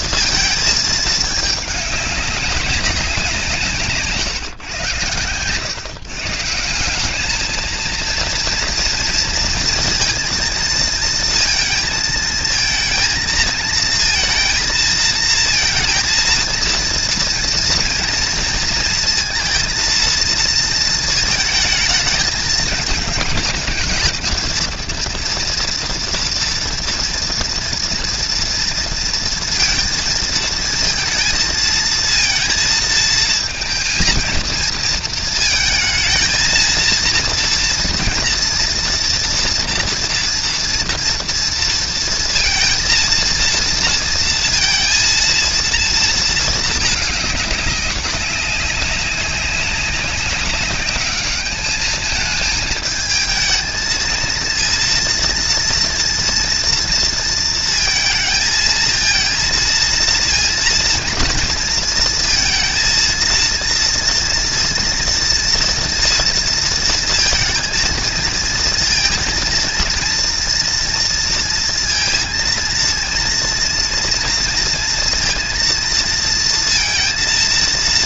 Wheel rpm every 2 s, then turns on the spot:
230, 200, 140, 170, 230, 230, 220, 230, 230, 230, 230, 220, 230, 230, 230, 220, 230, 220, 220, 230, 240, 230, 230, 220, 190, 190, 220, 230, 230, 220, 230, 230, 230, 230, 230, 230, 230, 230, 230.
none